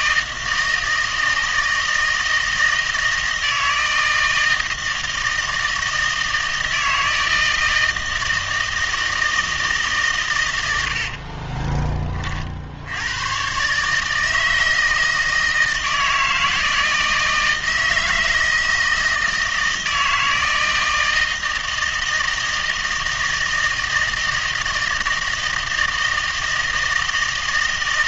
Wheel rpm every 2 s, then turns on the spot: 160, 160, 160, 160, 160, 90, 70, 160, 160, 160, 160, 160, 160, 160.
none